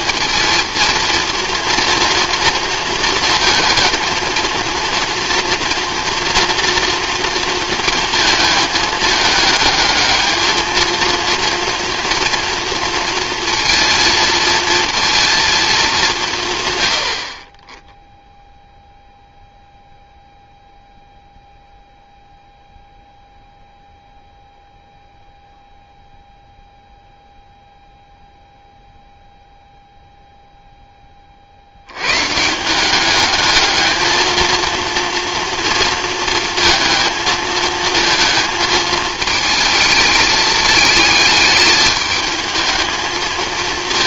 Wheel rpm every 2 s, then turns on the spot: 230, 230, 230, 240, 220, 220, 230, 230, 130, 0, 0, 0, 0, 0, 0, 0, 170, 230, 220, 220, 220, 220.
none